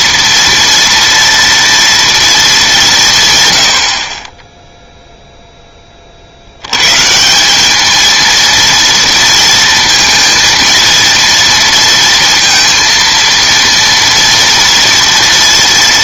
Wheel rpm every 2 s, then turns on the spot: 230, 210, 0, 100, 230, 230, 230, 230.
none